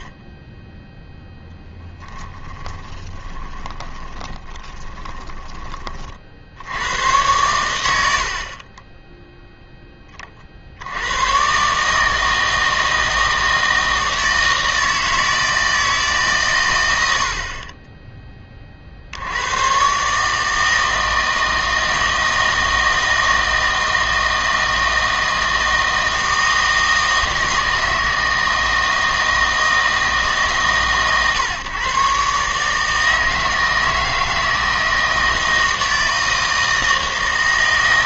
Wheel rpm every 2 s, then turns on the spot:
10, 20, 20, 80, 40, 60, 160, 160, 110, 40, 160, 160, 160, 160, 160, 140, 150, 160, 160.
2-6